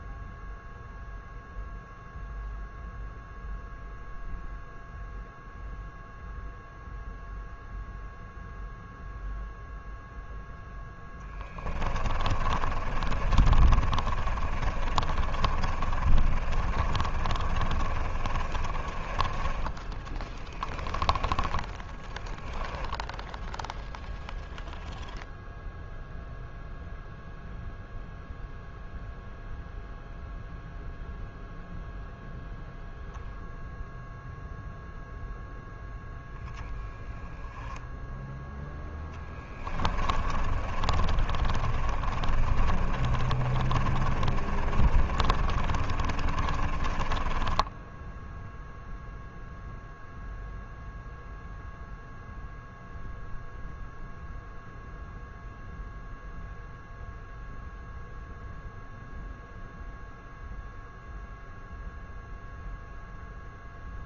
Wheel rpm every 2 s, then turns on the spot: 0, 0, 0, 0, 0, 0, 30, 30, 30, 30, 20, 10, 0, 0, 0, 0, 0, 0, 10, 10, 30, 30, 40, 30, 0, 0, 0, 0, 0, 0, 0, 0.
12-24 40-48